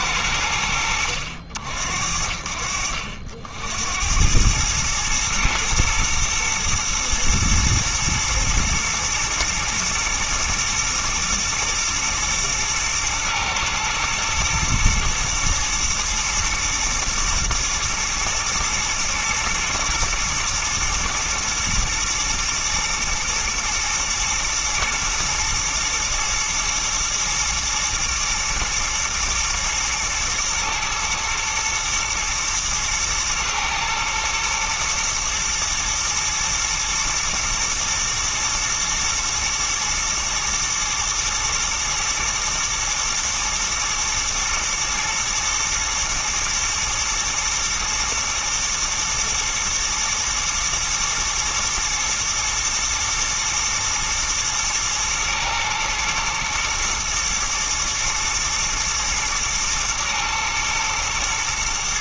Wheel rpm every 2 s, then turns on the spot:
90, 60, 110, 110, 120, 120, 110, 110, 110, 110, 120, 110, 120, 110, 110, 110, 110, 120, 110, 120, 120, 110, 120, 110, 110, 110, 120, 110, 110, 120, 120.
none